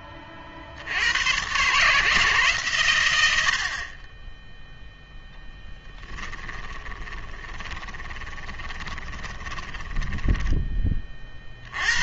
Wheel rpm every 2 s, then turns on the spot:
60, 140, 10, 20, 20, 20.
6-10